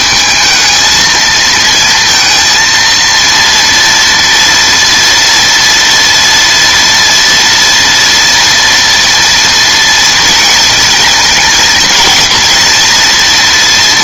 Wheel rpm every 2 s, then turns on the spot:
220, 230, 230, 240, 240, 230, 230.
none